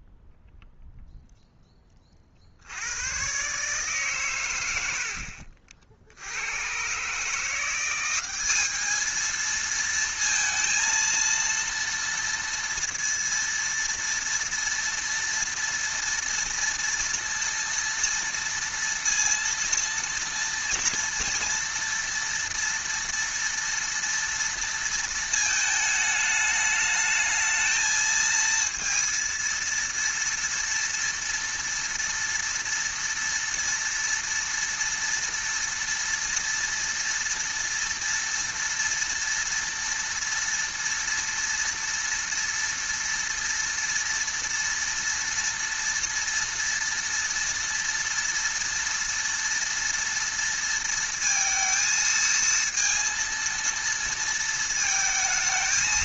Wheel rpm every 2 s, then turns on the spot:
0, 70, 90, 100, 210, 230, 230, 230, 230, 230, 230, 230, 230, 210, 230, 230, 230, 230, 230, 230, 230, 230, 230, 230, 230, 230, 230, 220.
none